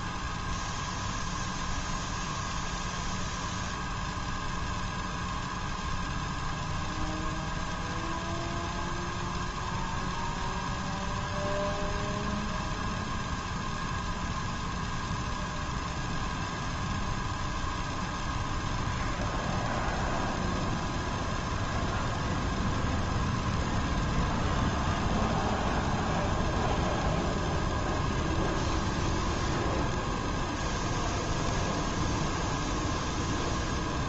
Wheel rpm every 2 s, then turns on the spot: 0, 0, 0, 0, 0, 0, 0, 0, 0, 0, 0, 0, 0, 0, 0, 0, 0.
none